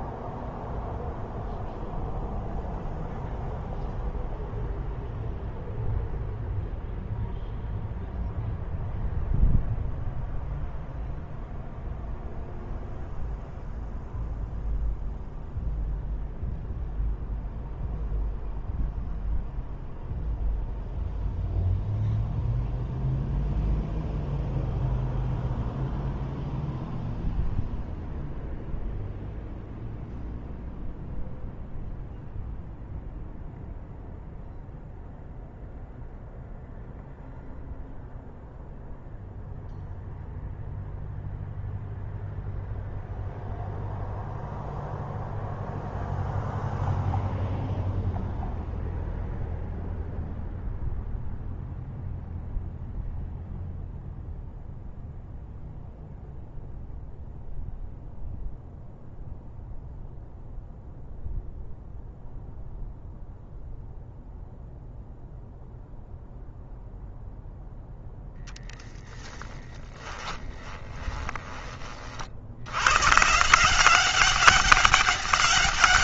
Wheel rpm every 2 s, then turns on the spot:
0, 0, 0, 0, 0, 0, 0, 0, 0, 0, 0, 0, 0, 0, 0, 0, 0, 0, 0, 0, 0, 0, 0, 0, 0, 0, 0, 0, 0, 0, 0, 0, 0, 0, 10, 20, 110, 200.
70-72